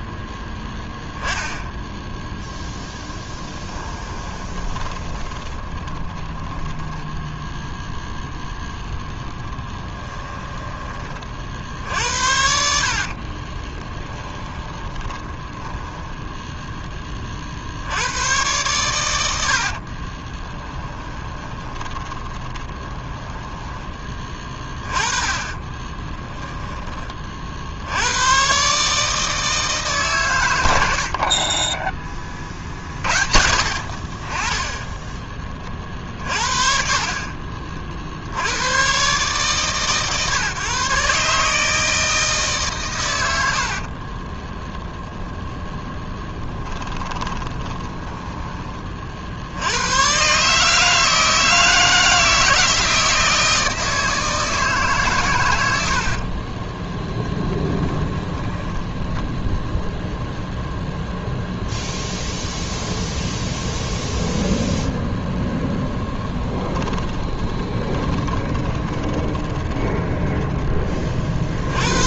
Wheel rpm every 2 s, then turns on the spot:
0, 10, 20, 20, 0, 20, 60, 20, 10, 110, 10, 20, 20, 10, 140, 80, 60, 20, 40, 110, 150, 120, 0, 10, 30, 150, 160, 140, 10, 10, 0, 0, 0, 20, 20, 30.
4-8 12-16 20-24 34-36 46-48 58-60 66-70